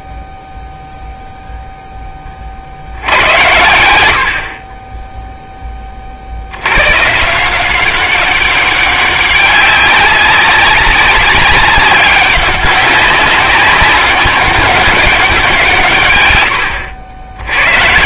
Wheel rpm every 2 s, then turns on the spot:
0, 70, 20, 120, 200, 200, 190, 200, 80.
4-6